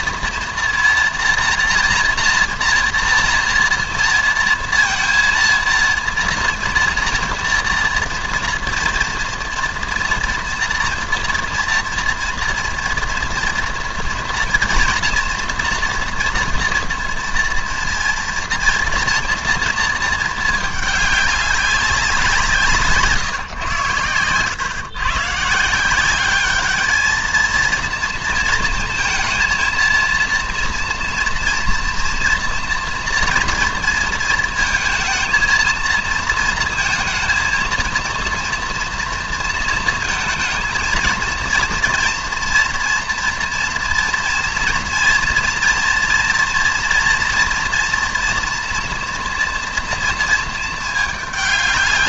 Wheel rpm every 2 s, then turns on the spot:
230, 240, 230, 230, 230, 230, 230, 230, 230, 230, 220, 170, 110, 210, 230, 230, 230, 230, 230, 230, 230, 230, 230, 230, 240, 220.
none